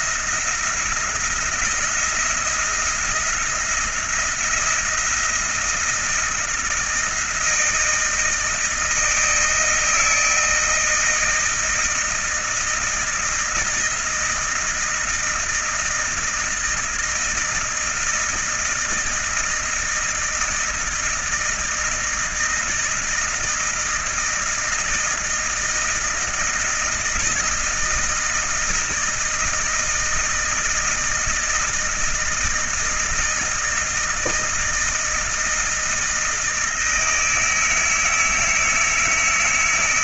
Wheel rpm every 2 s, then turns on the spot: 170, 170, 170, 160, 160, 160, 160, 160, 160, 160, 160, 160, 160, 160, 160, 160, 160, 160, 160, 160.
none